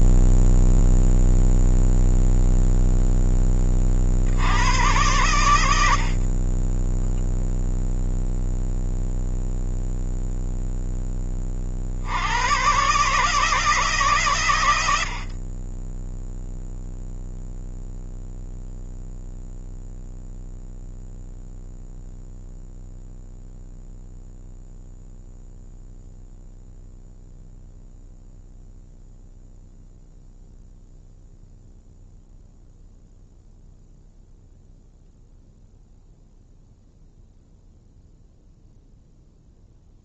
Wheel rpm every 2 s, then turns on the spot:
0, 0, 110, 20, 0, 10, 130, 90, 0, 0, 0, 0, 0, 0, 0, 0, 0, 0, 0, 0.
none